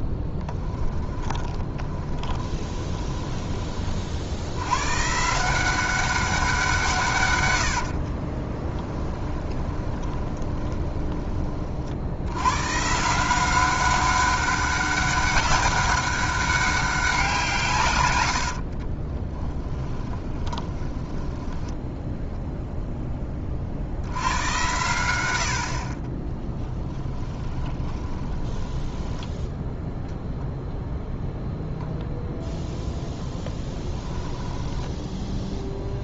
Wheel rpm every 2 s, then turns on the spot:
10, 20, 110, 170, 10, 20, 140, 200, 200, 50, 20, 0, 110, 10, 10, 0, 0, 10.
0-4 8-12 18-22 26-30 34-36